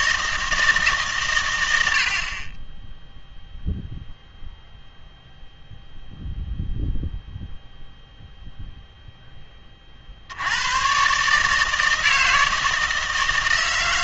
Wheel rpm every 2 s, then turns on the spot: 160, 20, 0, 0, 0, 110, 160.
none